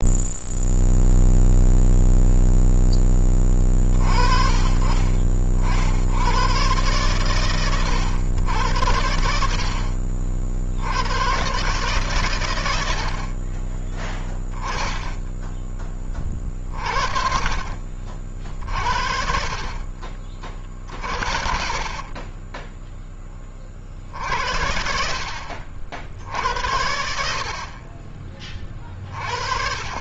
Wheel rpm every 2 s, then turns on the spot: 0, 10, 40, 120, 70, 90, 70, 10, 40, 50, 50, 10, 60, 70, 40.
18-24